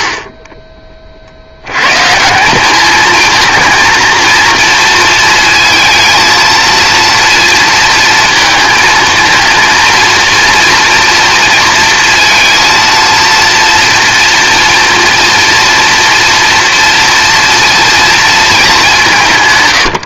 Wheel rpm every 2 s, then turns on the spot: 20, 190, 230, 230, 230, 230, 230, 230, 230, 210.
none